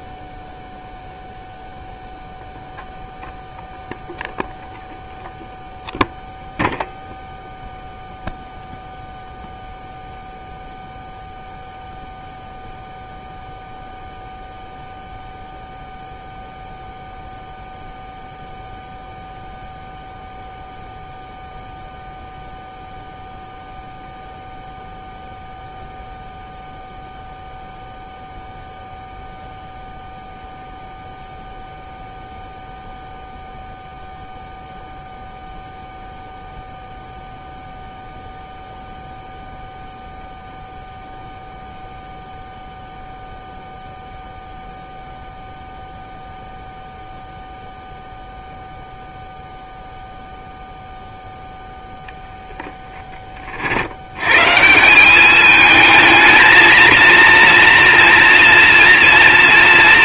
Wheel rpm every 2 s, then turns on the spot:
0, 0, 0, 0, 0, 0, 0, 0, 0, 0, 0, 0, 0, 0, 0, 0, 0, 0, 0, 0, 0, 0, 0, 0, 0, 0, 0, 140, 220, 230.
none